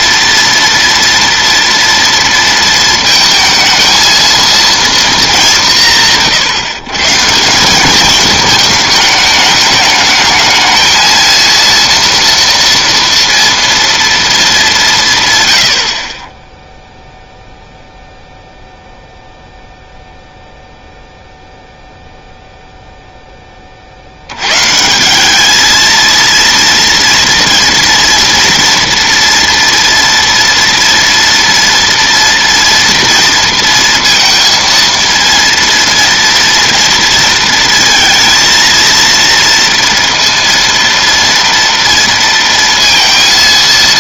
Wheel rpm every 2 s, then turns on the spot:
240, 230, 230, 150, 210, 220, 230, 190, 0, 0, 0, 0, 140, 230, 230, 230, 230, 230, 230, 230, 230, 230.
none